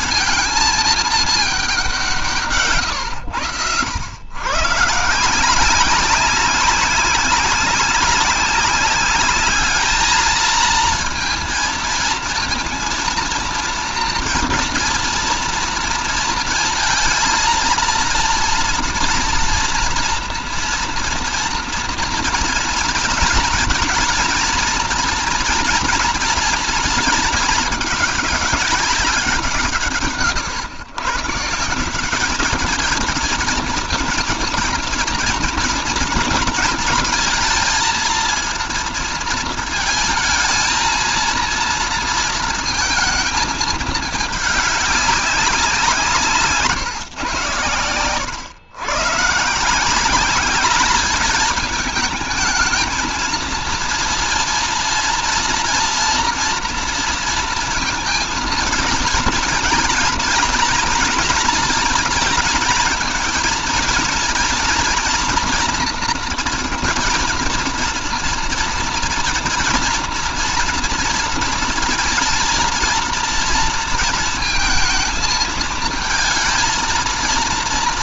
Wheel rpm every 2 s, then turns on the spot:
230, 130, 140, 190, 200, 230, 230, 230, 230, 230, 240, 230, 230, 230, 200, 130, 210, 230, 230, 230, 220, 230, 200, 140, 120, 200, 220, 230, 230, 230, 230, 220, 230, 240, 230, 230, 230, 230, 220.
none